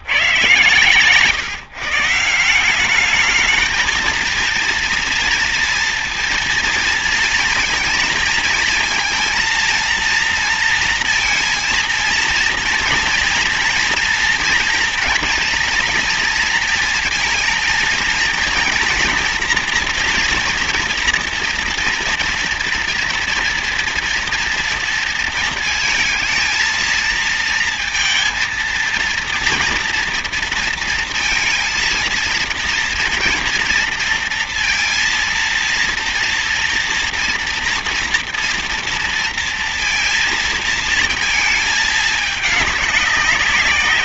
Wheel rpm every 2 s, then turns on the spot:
140, 180, 230, 230, 220, 230, 230, 230, 230, 230, 230, 230, 230, 230, 230, 230, 230, 230, 230, 230, 230, 200.
none